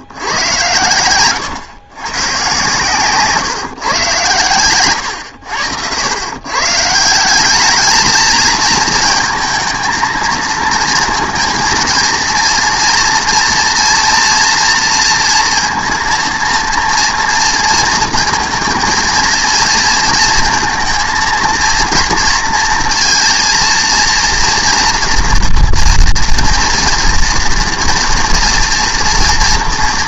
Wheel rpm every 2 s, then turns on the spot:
110, 130, 110, 140, 220, 230, 230, 230, 230, 230, 230, 230, 230, 240, 230.
none